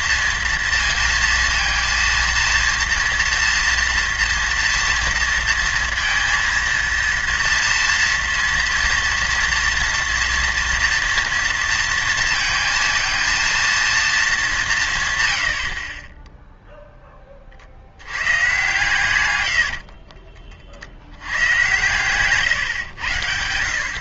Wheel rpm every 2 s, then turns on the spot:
230, 230, 230, 230, 230, 230, 230, 210, 10, 120, 40, 130.
16-18